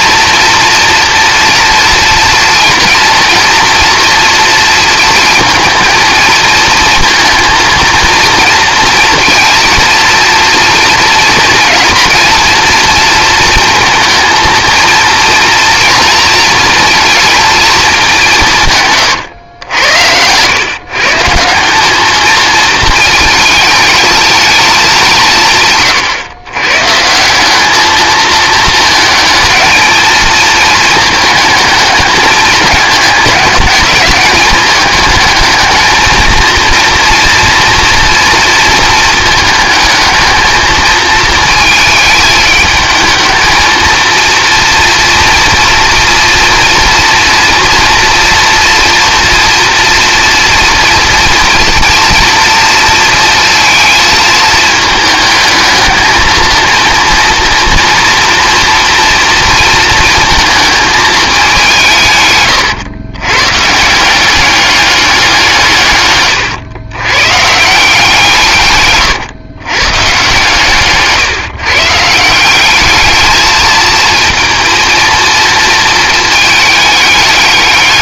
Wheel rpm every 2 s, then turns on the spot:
230, 230, 230, 230, 230, 230, 230, 230, 230, 130, 140, 220, 190, 140, 220, 220, 210, 210, 230, 220, 220, 220, 230, 230, 230, 230, 230, 220, 230, 230, 220, 110, 200, 110, 130, 140, 210, 230, 210.
18-20